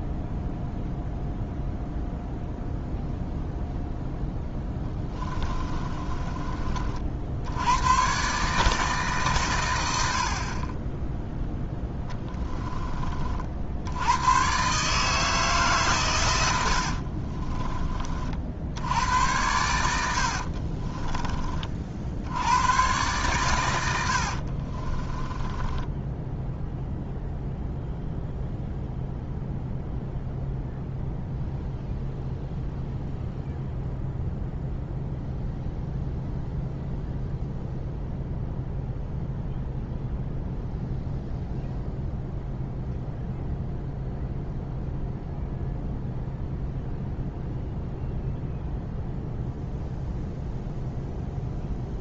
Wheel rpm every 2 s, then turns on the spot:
0, 0, 10, 40, 150, 20, 20, 140, 70, 80, 40, 110, 40, 0, 0, 0, 0, 0, 0, 0, 0, 0, 0, 0, 0, 0.
4-6 16-18 20-22 24-26